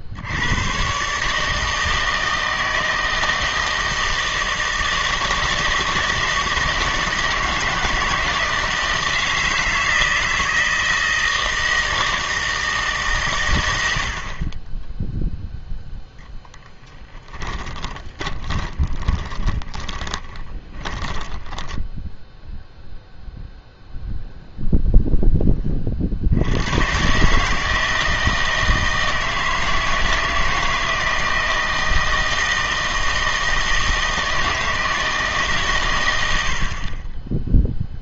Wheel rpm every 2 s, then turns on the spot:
120, 160, 160, 160, 160, 160, 150, 10, 10, 20, 30, 0, 0, 110, 160, 160, 160, 160, 30.
16-22